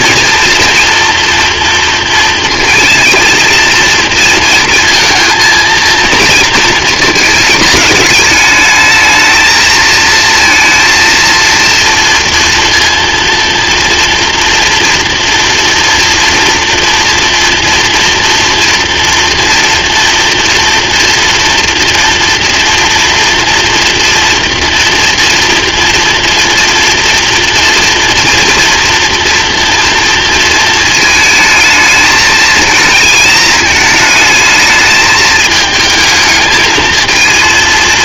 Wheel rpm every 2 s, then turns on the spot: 240, 220, 230, 230, 210, 230, 230, 230, 230, 240, 230, 230, 230, 230, 240, 230, 220, 220, 220.
none